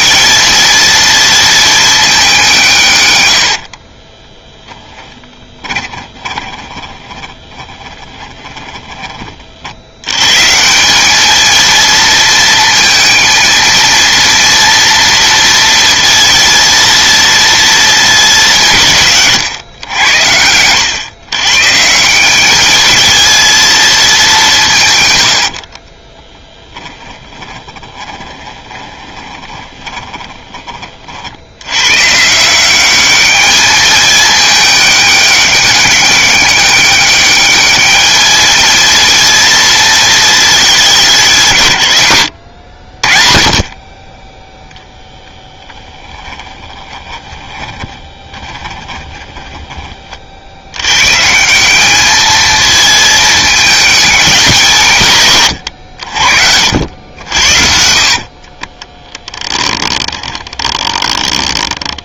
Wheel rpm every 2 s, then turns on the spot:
230, 160, 10, 20, 20, 180, 230, 230, 230, 160, 100, 220, 150, 20, 20, 30, 190, 210, 200, 230, 200, 70, 0, 20, 10, 110, 220, 150, 80, 20, 20.
4-8 26-30 46-50 56-62